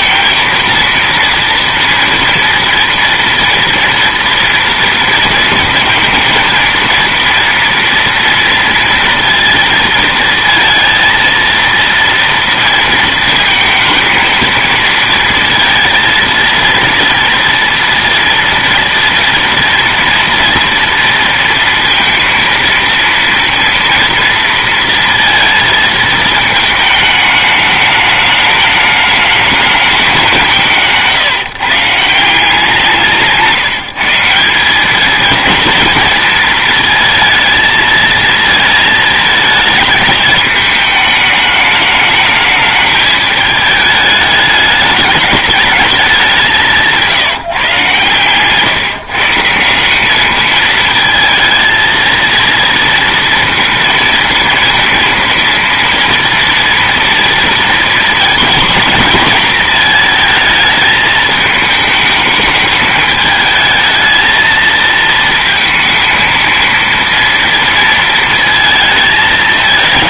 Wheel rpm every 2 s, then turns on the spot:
230, 230, 230, 230, 230, 230, 230, 220, 230, 230, 230, 230, 230, 220, 210, 170, 170, 200, 230, 220, 220, 210, 210, 180, 140, 220, 230, 230, 230, 230, 220, 210, 220, 230, 230.
46-48